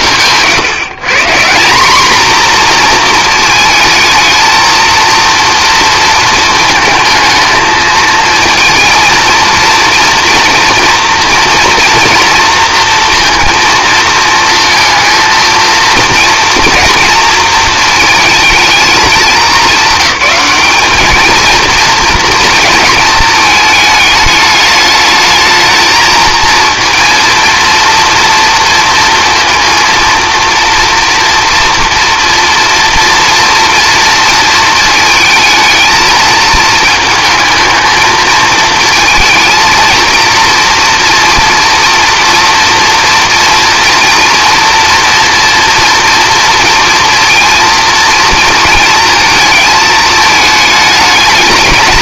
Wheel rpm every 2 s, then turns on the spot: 150, 230, 230, 220, 230, 240, 230, 230, 230, 210, 210, 220, 210, 230, 230, 230, 230, 230, 220, 220, 240, 240, 230, 230, 220, 210.
none